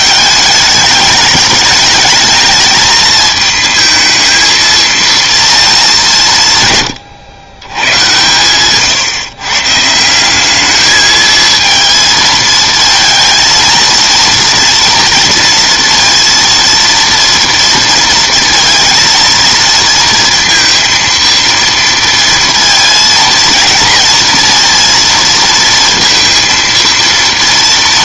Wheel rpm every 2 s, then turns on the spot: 210, 220, 230, 140, 120, 200, 230, 230, 230, 230, 230, 230, 230, 230.
none